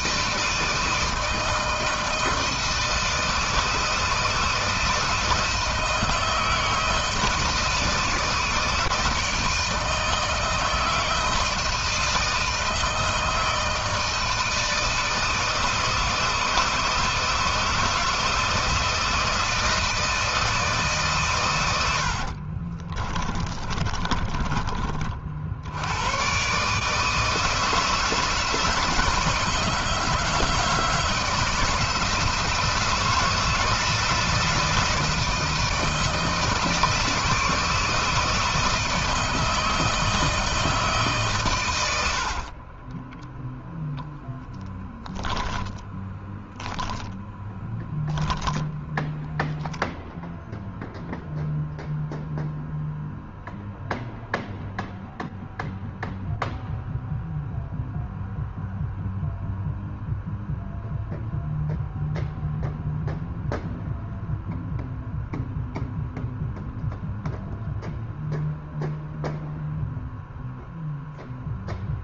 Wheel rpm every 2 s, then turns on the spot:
160, 160, 160, 160, 160, 160, 160, 160, 160, 160, 150, 40, 30, 150, 160, 160, 160, 160, 160, 160, 150, 20, 10, 0, 0, 0, 0, 0, 0, 0, 0, 0, 0, 0, 0, 0.
22-24 42-44